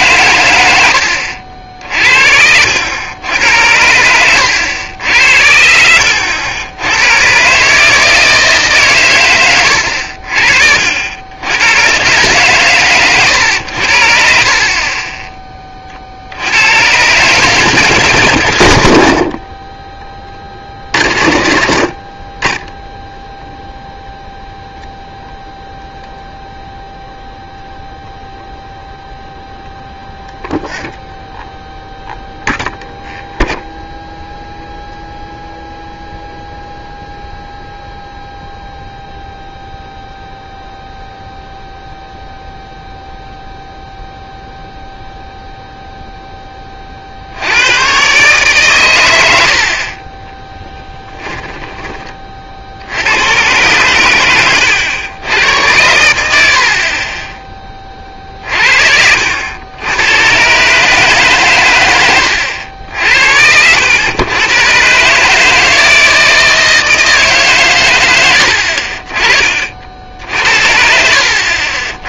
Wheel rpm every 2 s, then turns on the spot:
90, 90, 90, 100, 140, 50, 120, 30, 100, 140, 60, 10, 0, 0, 0, 0, 0, 0, 0, 0, 0, 0, 0, 40, 110, 20, 80, 100, 30, 50, 150, 70, 130, 160, 50, 60.
14-16 50-52 56-58 70-72